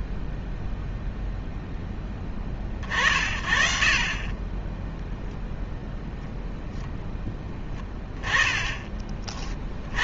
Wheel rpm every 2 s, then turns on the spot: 10, 40, 10, 0, 20.
none